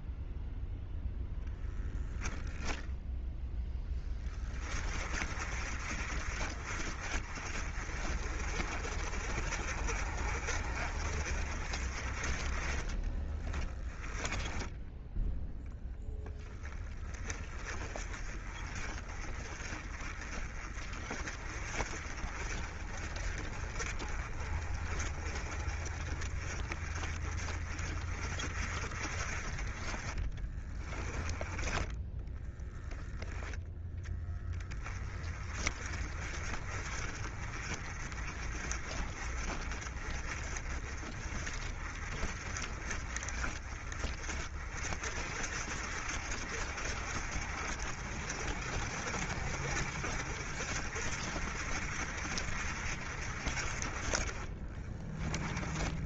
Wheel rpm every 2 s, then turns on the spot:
0, 0, 30, 40, 40, 40, 20, 10, 20, 30, 30, 40, 40, 30, 40, 10, 20, 20, 40, 40, 40, 40, 50, 60, 50, 60, 50, 20.
12-14 30-32 54-56